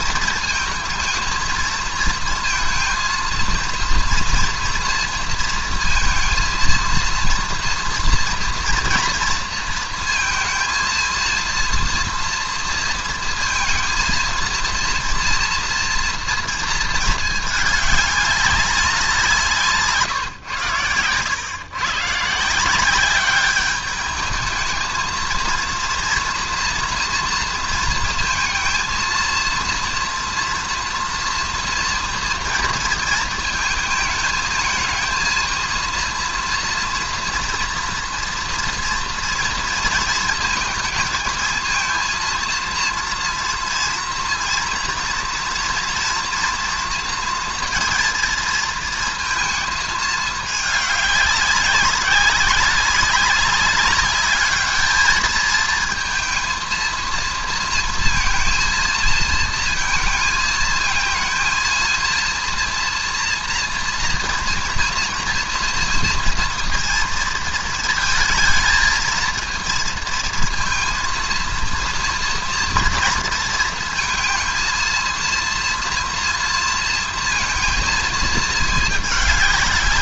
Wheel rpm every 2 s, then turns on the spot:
220, 230, 230, 230, 230, 230, 230, 230, 230, 200, 110, 170, 210, 230, 230, 230, 240, 220, 230, 230, 220, 230, 240, 230, 230, 210, 190, 210, 230, 230, 230, 230, 230, 230, 220, 230, 230, 230, 230, 220.
none